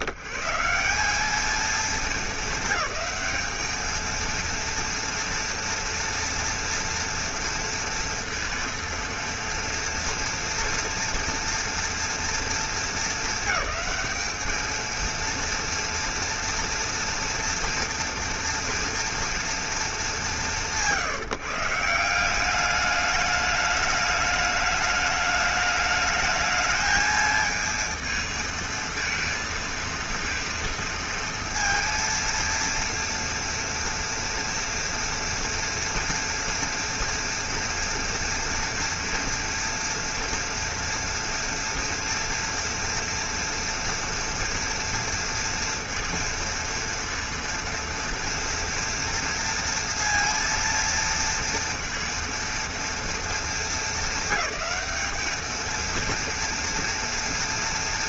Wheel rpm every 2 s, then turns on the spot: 80, 210, 230, 230, 230, 230, 230, 220, 230, 230, 200, 180, 210, 210, 220, 230, 230, 230, 230, 230, 230, 230, 230, 230, 230, 230, 230, 210, 230.
none